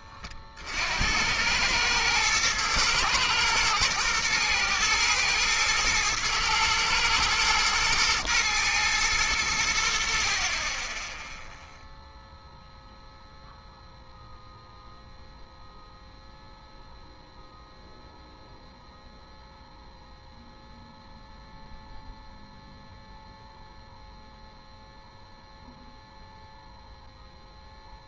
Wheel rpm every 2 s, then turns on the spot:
110, 120, 110, 120, 80, 0, 0, 0, 0, 0, 0, 0, 0, 0.
none